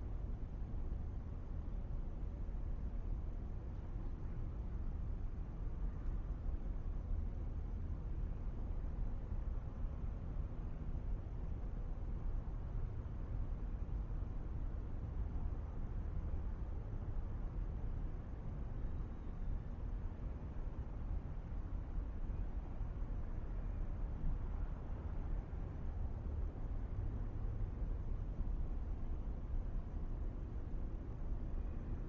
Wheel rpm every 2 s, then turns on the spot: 0, 0, 0, 0, 0, 0, 0, 0, 0, 0, 0, 0, 0, 0, 0, 0.
none